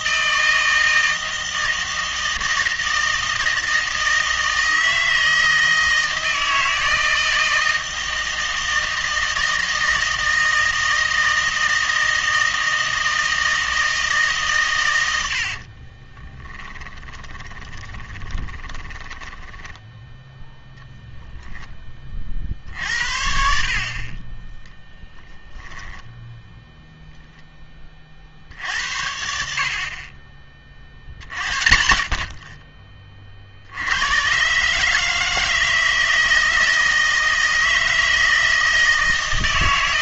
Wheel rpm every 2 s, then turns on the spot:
160, 160, 160, 160, 160, 160, 160, 120, 10, 20, 0, 60, 10, 0, 70, 50, 30, 140, 160, 160.
16-20